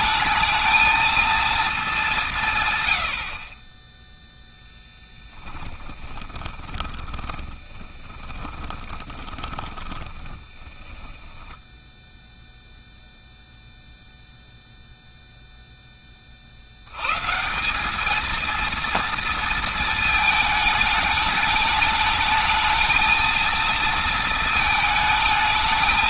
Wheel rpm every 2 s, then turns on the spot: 220, 120, 10, 10, 10, 20, 0, 0, 90, 230, 210, 220, 220.
4-12